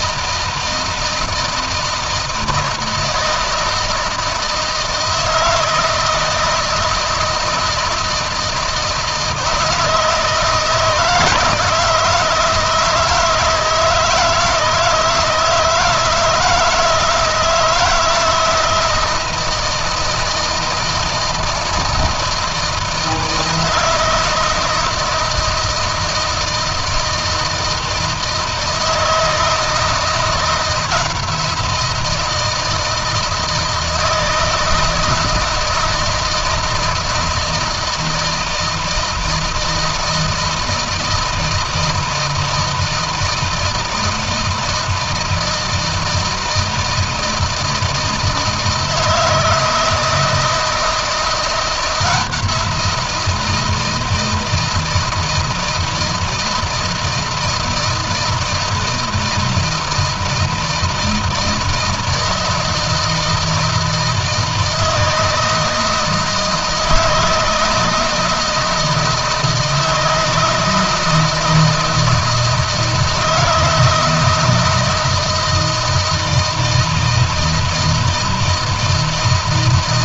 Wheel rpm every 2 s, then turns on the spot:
160, 160, 160, 160, 160, 160, 160, 160, 160, 160, 160, 160, 170, 160, 160, 170, 160, 160, 160, 160, 160, 160, 160, 160, 160, 170, 170, 160, 160, 160, 160, 160, 160, 160, 160, 160, 160, 160, 160, 160.
none